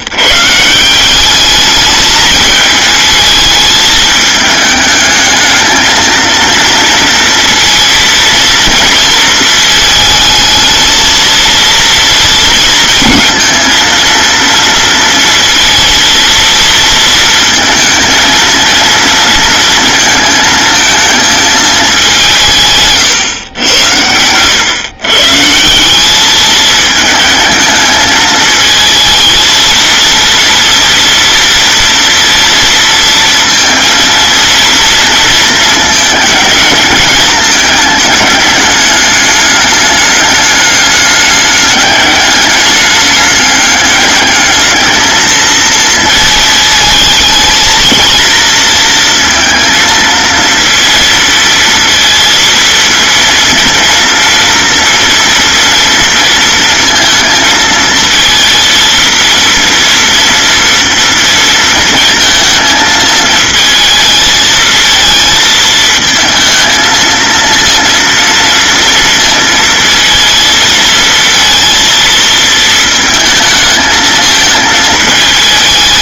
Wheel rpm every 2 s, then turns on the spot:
170, 220, 220, 230, 230, 220, 220, 230, 230, 230, 220, 160, 120, 220, 220, 230, 230, 230, 210, 210, 200, 210, 220, 220, 230, 230, 230, 230, 230, 230, 230, 220, 220, 220, 230, 230, 220, 220.
none